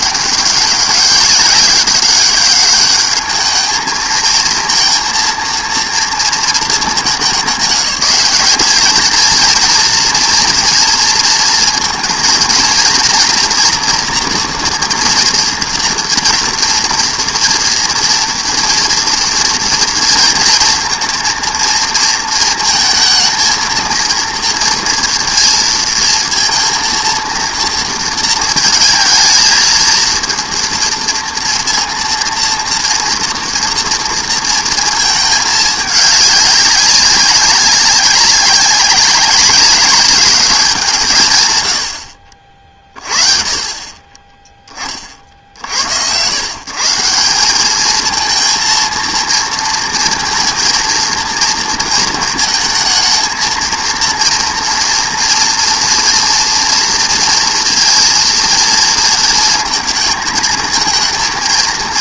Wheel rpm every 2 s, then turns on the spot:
200, 200, 230, 220, 220, 230, 230, 230, 230, 230, 230, 230, 230, 230, 220, 230, 230, 230, 200, 200, 180, 40, 10, 130, 230, 230, 220, 230, 230, 230, 220.
none